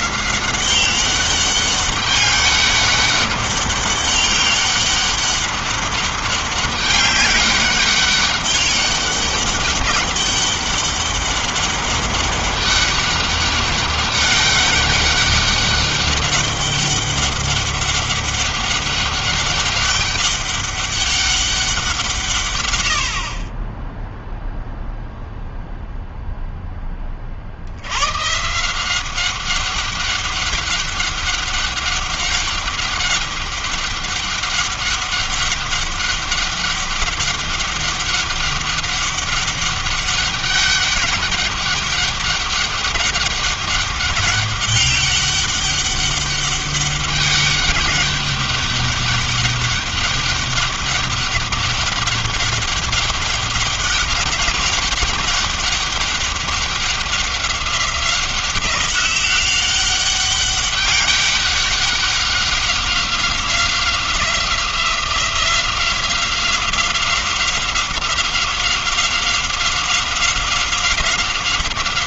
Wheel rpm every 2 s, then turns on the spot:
190, 200, 200, 200, 200, 200, 200, 200, 200, 200, 200, 70, 0, 30, 180, 200, 200, 200, 200, 200, 200, 200, 200, 200, 200, 200, 200, 200, 190, 190, 200, 190, 180, 190, 190, 190.
none